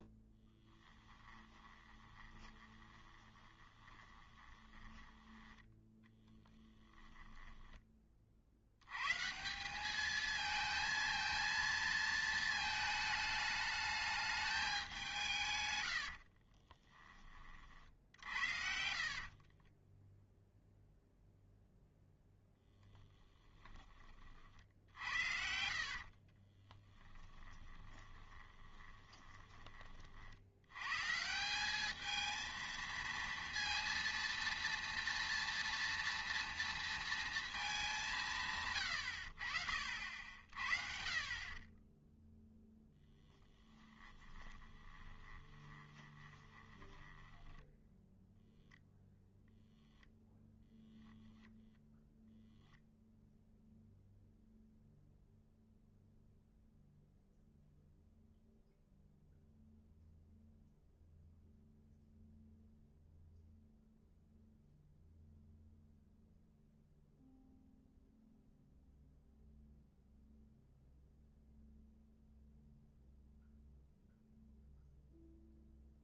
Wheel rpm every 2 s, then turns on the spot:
10, 20, 20, 20, 100, 220, 220, 200, 20, 60, 0, 20, 70, 20, 20, 120, 230, 230, 230, 120, 50, 10, 20, 20, 0, 10, 0, 0, 0, 0, 0, 0, 0, 0, 0, 0, 0, 0.
0-8 16-20 22-30 44-48 50-52